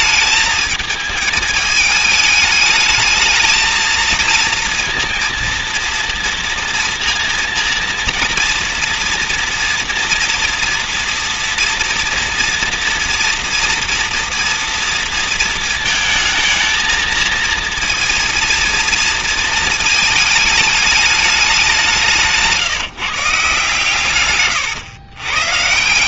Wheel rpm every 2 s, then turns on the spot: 220, 210, 230, 230, 230, 240, 230, 230, 220, 230, 220, 170, 130.
none